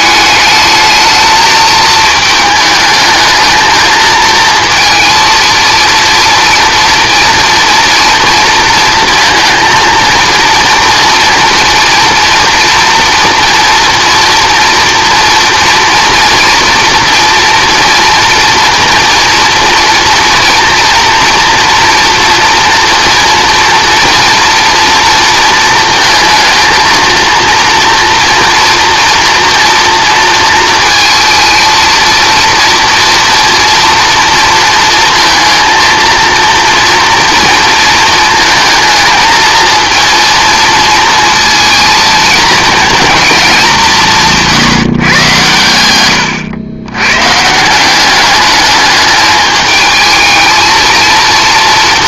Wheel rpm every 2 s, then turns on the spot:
220, 220, 230, 230, 230, 230, 230, 240, 240, 240, 230, 230, 230, 220, 230, 230, 230, 230, 230, 230, 230, 230, 150, 110, 210, 220.
none